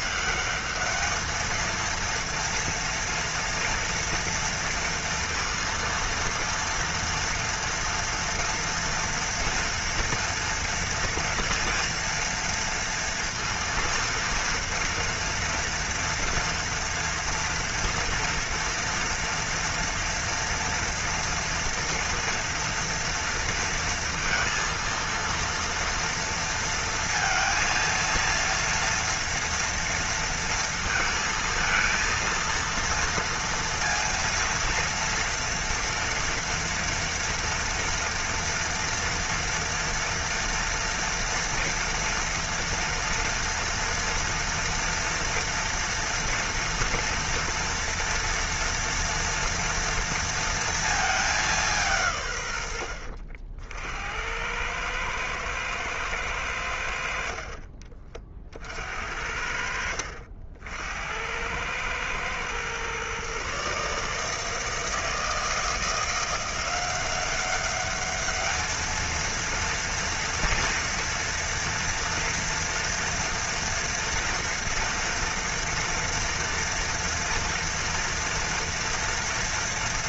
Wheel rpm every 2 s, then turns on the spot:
210, 230, 230, 230, 230, 230, 230, 230, 230, 230, 240, 240, 230, 230, 230, 230, 230, 230, 240, 230, 230, 230, 230, 230, 230, 230, 110, 100, 90, 50, 70, 120, 160, 180, 220, 230, 230, 230, 230, 230.
none